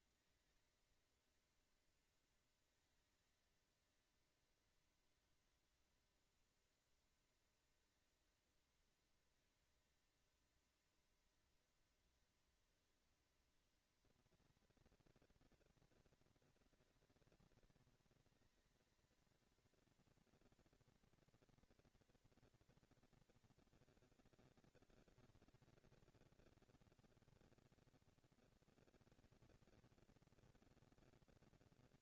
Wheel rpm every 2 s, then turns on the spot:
230, 220, 230, 230, 230, 230, 230, 230, 230, 230, 230, 220, 200, 200, 220, 230.
none